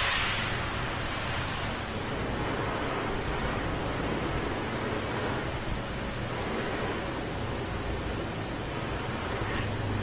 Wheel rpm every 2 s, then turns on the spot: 0, 0, 0, 0, 0.
none